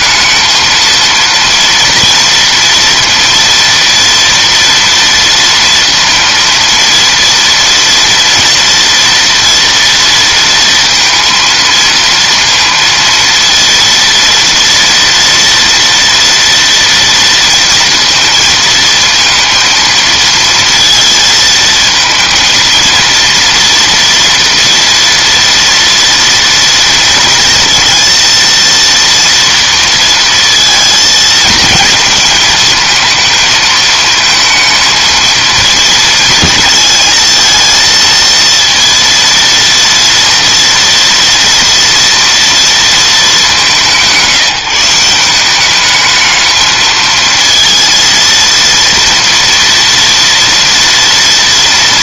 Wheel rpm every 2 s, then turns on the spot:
230, 230, 230, 230, 240, 230, 230, 230, 240, 230, 230, 230, 230, 230, 230, 230, 220, 220, 220, 230, 230, 220, 170, 220, 230, 230.
none